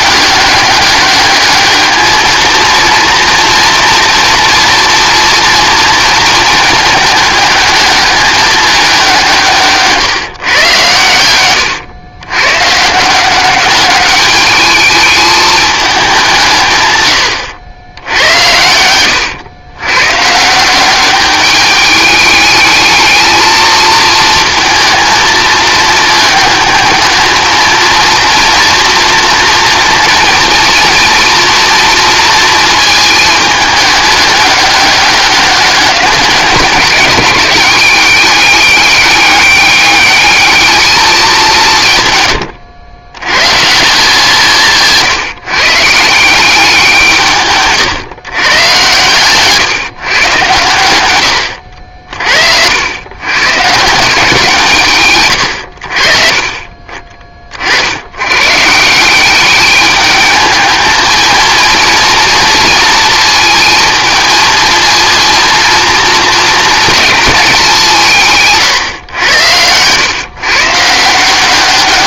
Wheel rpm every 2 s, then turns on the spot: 200, 220, 230, 220, 210, 130, 130, 210, 140, 100, 170, 210, 220, 210, 230, 230, 230, 200, 180, 200, 210, 110, 160, 180, 120, 110, 80, 150, 30, 140, 220, 230, 220, 220, 140, 150.
68-70